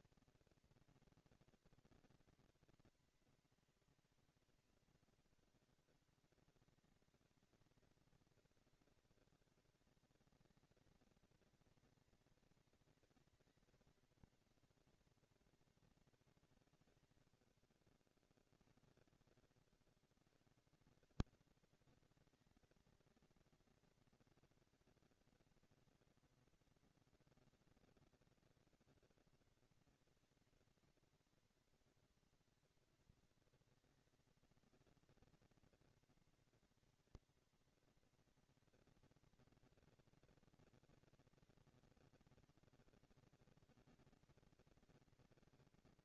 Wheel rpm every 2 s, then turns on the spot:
230, 230, 220, 200, 200, 230, 230, 230, 190, 100, 160, 230, 230, 230, 230, 230, 230, 230, 230, 230, 230, 230, 230.
none